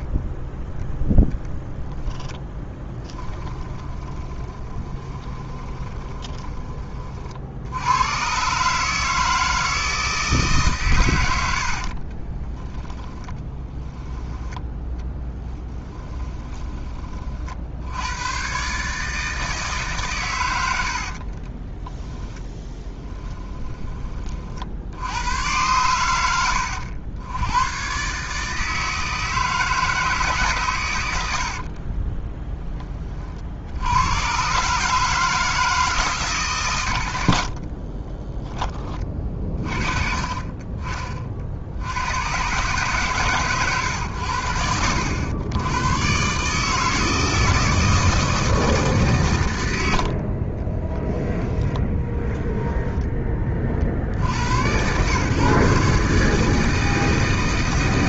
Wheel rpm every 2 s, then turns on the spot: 10, 20, 20, 30, 150, 130, 10, 20, 30, 140, 80, 20, 60, 100, 160, 120, 20, 150, 100, 20, 30, 130, 90, 160, 150, 20, 10, 100, 160.
2-6 12-16 20-24 50-52